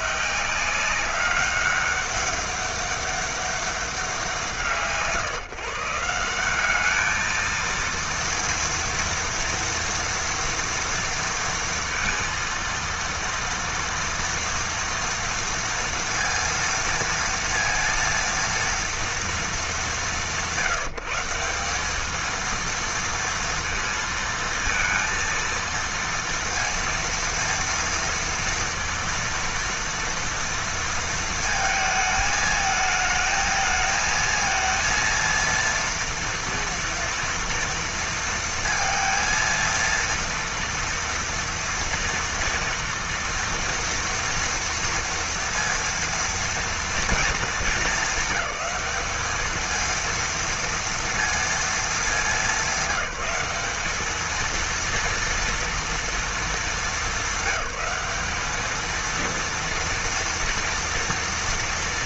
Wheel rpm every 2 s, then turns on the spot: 190, 200, 160, 210, 230, 230, 230, 230, 230, 230, 170, 230, 230, 230, 230, 230, 220, 230, 230, 230, 230, 230, 230, 230, 200, 230, 190, 230, 220, 220, 230.
none